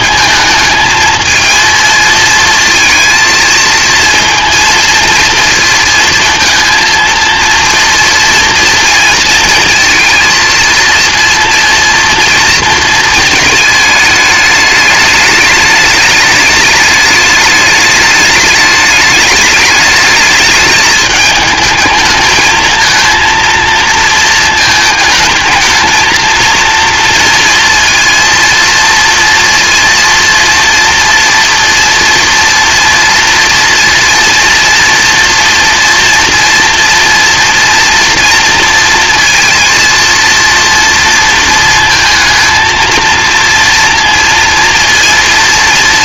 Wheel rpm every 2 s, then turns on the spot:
220, 230, 230, 230, 230, 230, 230, 210, 210, 210, 220, 220, 220, 230, 230, 230, 230, 230, 230, 230, 230, 230, 230.
none